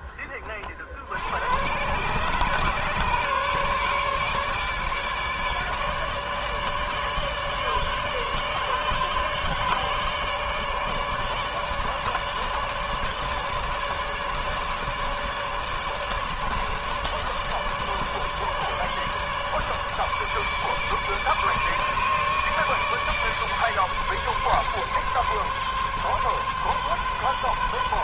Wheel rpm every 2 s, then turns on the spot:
30, 130, 150, 150, 150, 150, 150, 150, 150, 150, 150, 150, 140, 140.
none